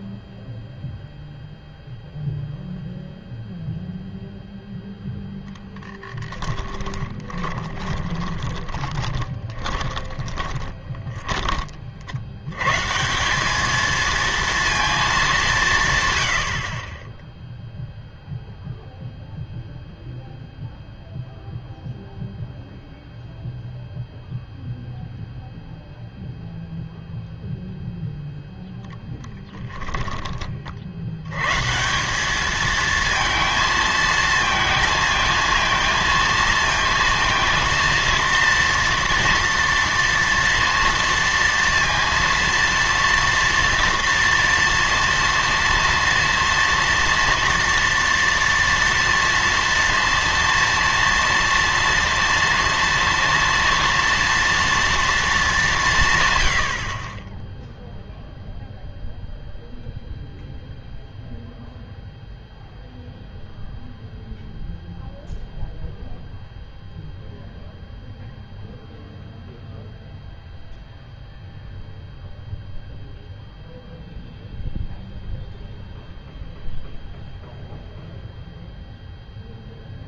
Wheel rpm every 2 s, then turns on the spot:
0, 0, 0, 20, 20, 20, 120, 230, 70, 0, 0, 0, 0, 0, 0, 40, 220, 220, 230, 230, 230, 230, 230, 230, 230, 230, 230, 230, 90, 0, 0, 0, 0, 0, 0, 0, 0, 0, 0, 0.
6-12